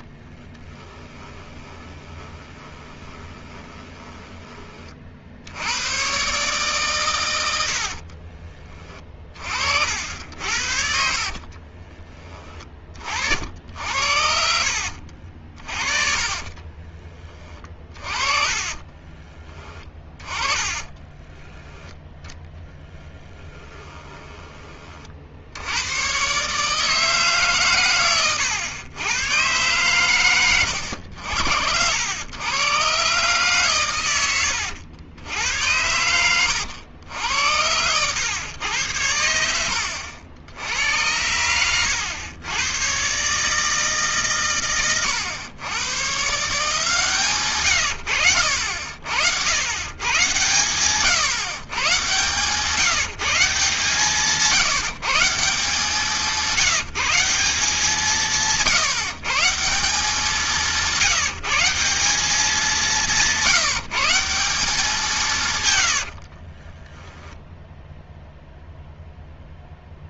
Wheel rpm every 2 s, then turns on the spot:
10, 20, 30, 130, 30, 60, 30, 60, 40, 20, 20, 10, 30, 150, 100, 90, 130, 90, 100, 100, 90, 120, 120, 160, 70, 130, 160, 160, 180, 170, 160, 190, 190, 10, 0.
0-4 8-10 14-16 18-22 66-68